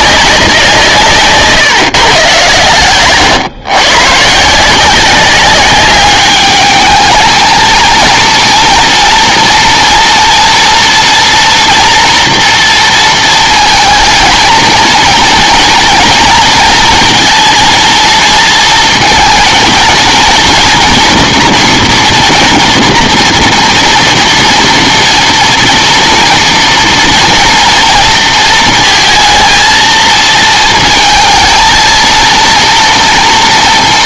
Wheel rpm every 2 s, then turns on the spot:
180, 120, 160, 210, 230, 230, 230, 230, 230, 230, 230, 230, 230, 230, 230, 220, 230.
none